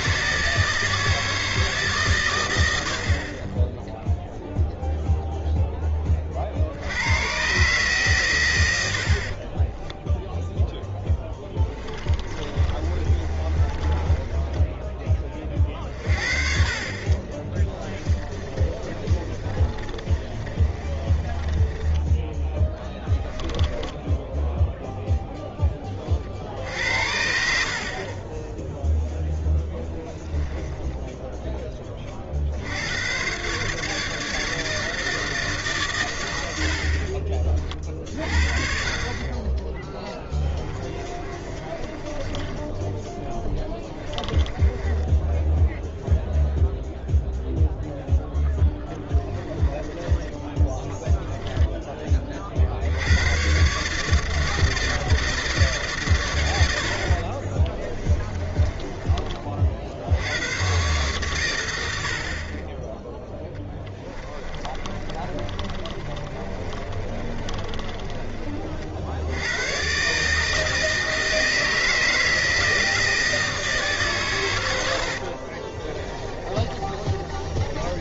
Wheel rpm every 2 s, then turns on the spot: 160, 100, 0, 60, 100, 0, 30, 10, 50, 30, 30, 10, 0, 60, 10, 10, 60, 160, 70, 50, 20, 20, 20, 0, 10, 10, 50, 160, 90, 20, 120, 30, 20, 40, 40, 150, 160, 110, 30.
12-16 18-22 30-32 40-46 48-50 58-60 64-68 76-78